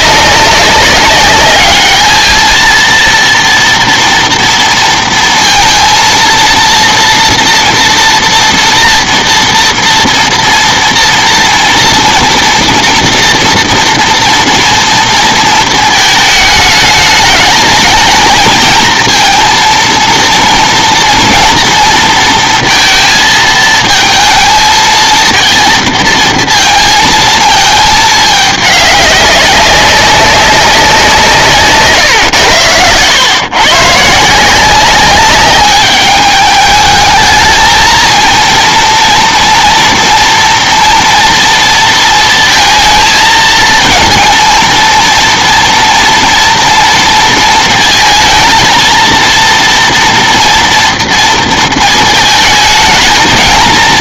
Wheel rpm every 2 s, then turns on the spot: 200, 230, 230, 230, 240, 230, 230, 240, 210, 220, 230, 230, 230, 230, 210, 190, 100, 180, 210, 230, 240, 220, 230, 230, 230, 230, 220.
none